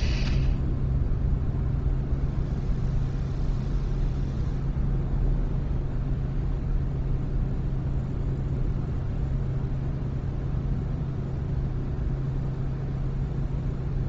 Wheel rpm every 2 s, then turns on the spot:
0, 0, 0, 0, 0, 0, 0.
none